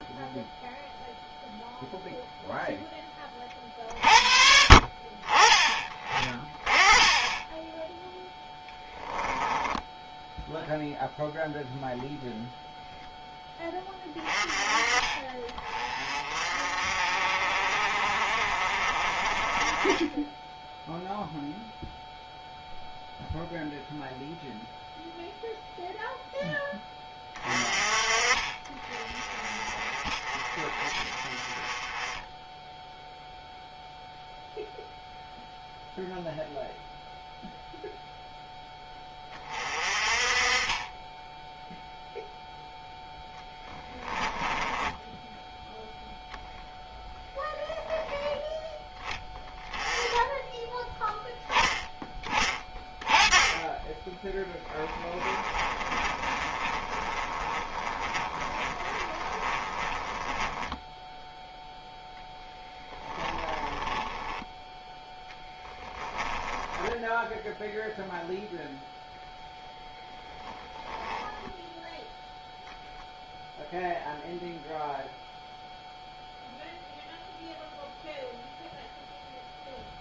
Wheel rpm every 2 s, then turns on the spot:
0, 0, 50, 30, 10, 0, 0, 20, 40, 40, 10, 0, 0, 10, 30, 30, 0, 0, 0, 10, 20, 0, 10, 0, 10, 10, 20, 20, 20, 20, 10, 10, 0, 10, 0, 10, 0, 0, 0, 0.
8-10 44-46 54-60 62-64